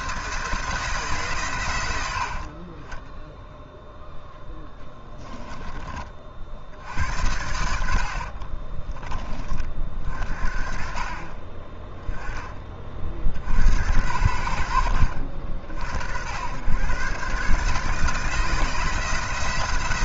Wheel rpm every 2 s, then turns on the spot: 160, 30, 10, 70, 40, 40, 40, 70, 120, 160.
8-10